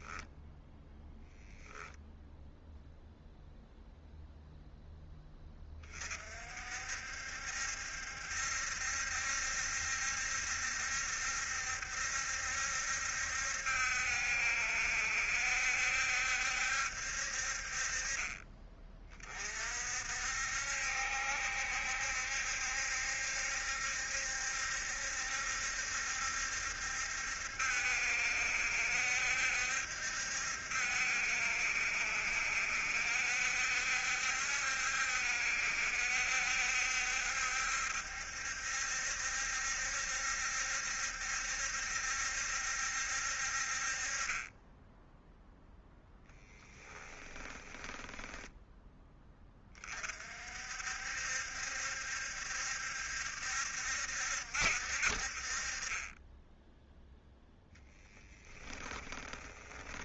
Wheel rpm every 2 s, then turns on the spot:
0, 0, 0, 60, 70, 70, 70, 70, 70, 30, 70, 70, 70, 70, 70, 70, 70, 70, 70, 70, 70, 70, 10, 10, 10, 60, 70, 60, 0, 30.
46-48 58-60